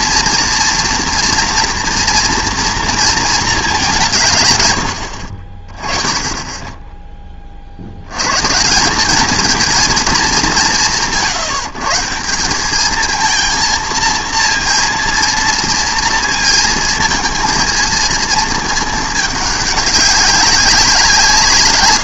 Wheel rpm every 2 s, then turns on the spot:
240, 230, 100, 20, 160, 170, 210, 230, 230, 220, 180.
none